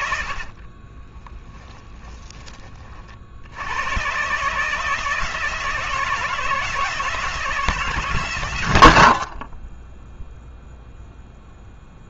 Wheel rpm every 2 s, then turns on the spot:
50, 30, 150, 160, 110, 0.
0-2